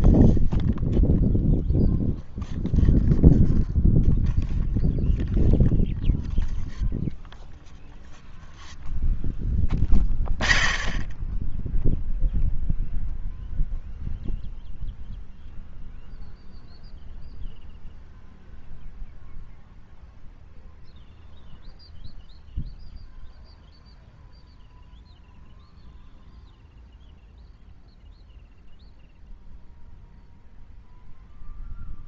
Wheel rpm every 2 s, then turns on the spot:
0, 0, 0, 0, 0, 0, 0, 0, 0, 0, 0, 0, 0, 0, 0, 0.
none